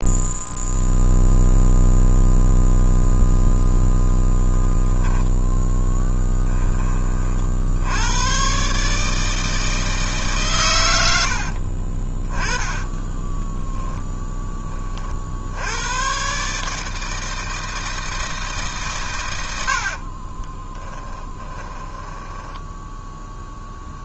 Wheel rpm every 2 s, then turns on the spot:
0, 0, 10, 40, 150, 90, 10, 50, 160, 120, 10, 10.
12-14 20-22